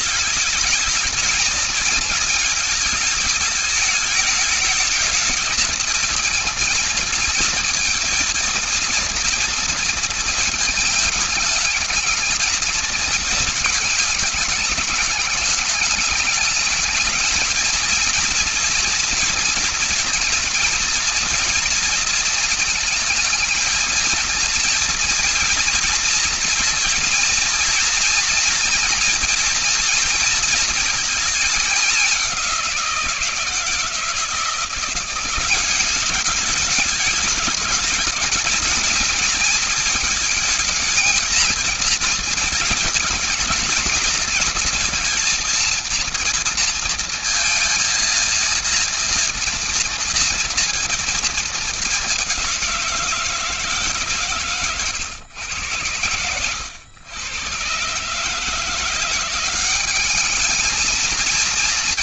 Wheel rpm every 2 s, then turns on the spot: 220, 220, 210, 230, 230, 220, 220, 210, 210, 230, 230, 230, 230, 230, 230, 230, 190, 170, 210, 220, 220, 230, 230, 230, 230, 230, 180, 140, 90, 150, 210.
none